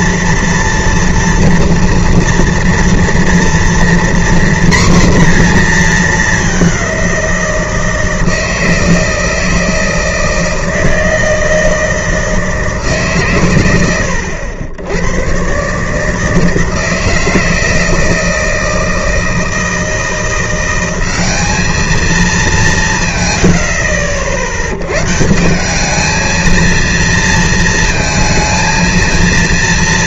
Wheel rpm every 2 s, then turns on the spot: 240, 230, 240, 200, 160, 160, 160, 80, 160, 160, 180, 190, 80, 220, 230.
none